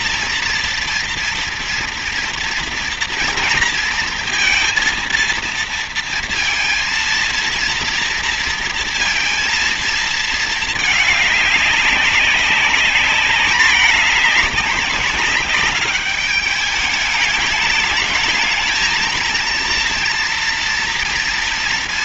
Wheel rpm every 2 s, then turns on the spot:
230, 230, 230, 230, 230, 210, 210, 200, 210, 220, 230.
none